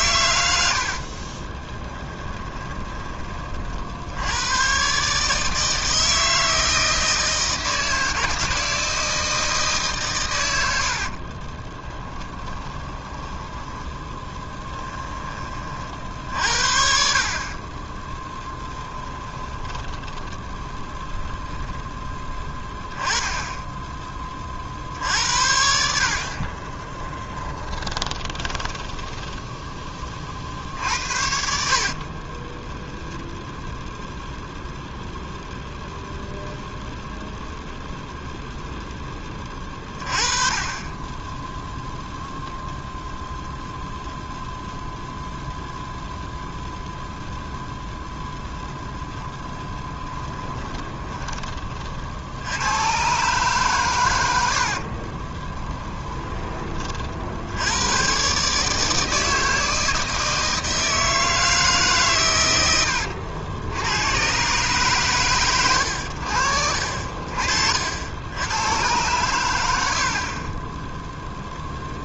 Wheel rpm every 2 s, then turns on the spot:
40, 20, 130, 160, 160, 70, 20, 10, 50, 10, 10, 10, 60, 20, 10, 70, 0, 0, 0, 10, 20, 0, 0, 0, 0, 20, 120, 30, 50, 160, 160, 100, 130, 50, 110, 10.
0-2 10-14 18-22 26-30 50-52 54-56 62-64